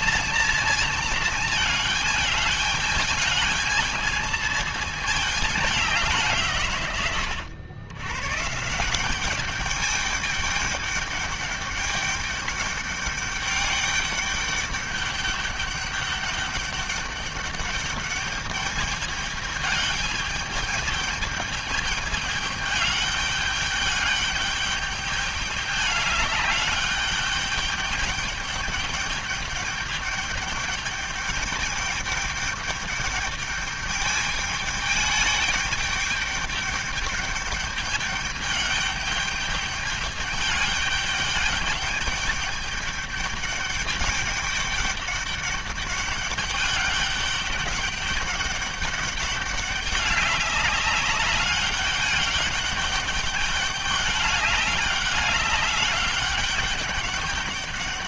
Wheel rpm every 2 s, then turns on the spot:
220, 220, 210, 130, 180, 210, 200, 210, 200, 210, 210, 210, 210, 200, 210, 210, 210, 210, 210, 210, 210, 210, 200, 200, 200, 200, 210, 200, 200.
none